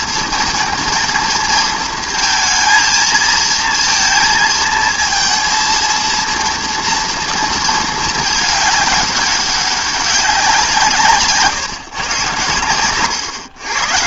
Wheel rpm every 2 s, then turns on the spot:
230, 230, 230, 230, 210, 170, 110.
12-14